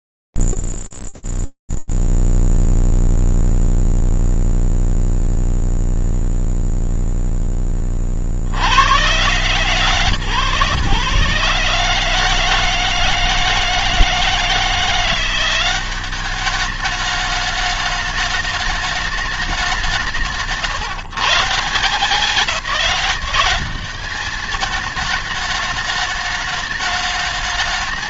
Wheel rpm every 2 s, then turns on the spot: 0, 0, 0, 0, 30, 140, 160, 160, 200, 210, 170, 190, 200, 210.
none